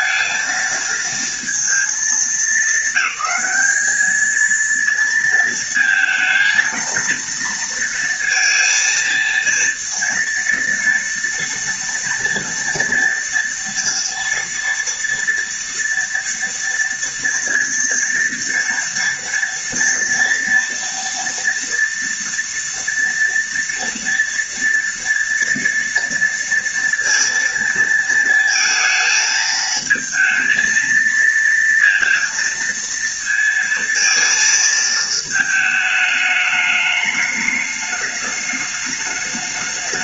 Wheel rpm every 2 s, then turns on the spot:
230, 200, 230, 230, 230, 230, 230, 230, 230, 230, 230, 230, 230, 230, 230, 230, 230, 220, 210, 210.
none